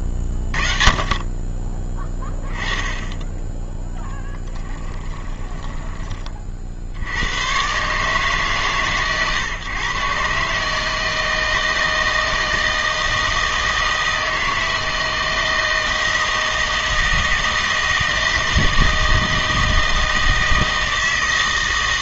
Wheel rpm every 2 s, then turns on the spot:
30, 20, 10, 20, 150, 140, 160, 160, 160, 160, 160.
none